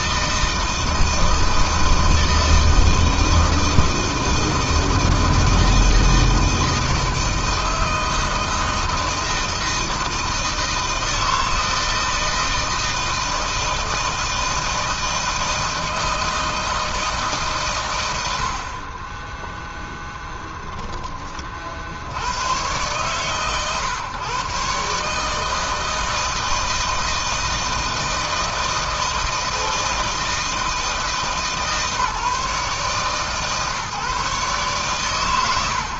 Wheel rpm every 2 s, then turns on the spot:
160, 160, 160, 160, 160, 160, 160, 160, 150, 20, 30, 130, 150, 160, 160, 160, 140, 100.
none